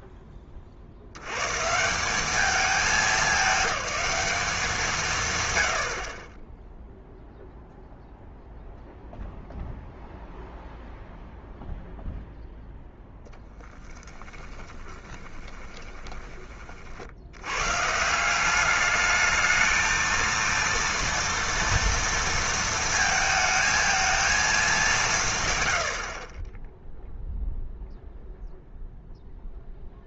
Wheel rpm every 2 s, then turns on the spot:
20, 210, 210, 20, 0, 0, 0, 20, 30, 200, 230, 230, 210, 20, 0.
14-16